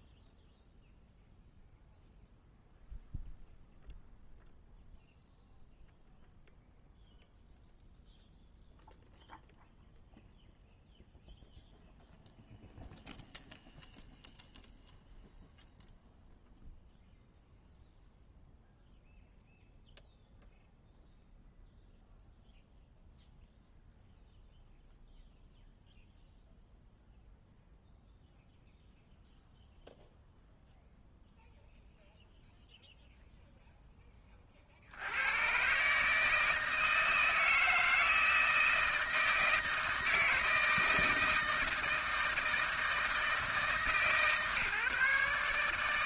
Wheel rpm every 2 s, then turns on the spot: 0, 0, 0, 0, 0, 0, 0, 0, 0, 0, 0, 0, 0, 0, 0, 0, 0, 50, 160, 160, 160, 160, 150.
none